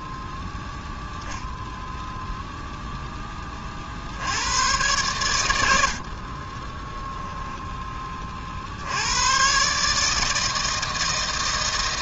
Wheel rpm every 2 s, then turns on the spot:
0, 0, 90, 30, 50, 160.
none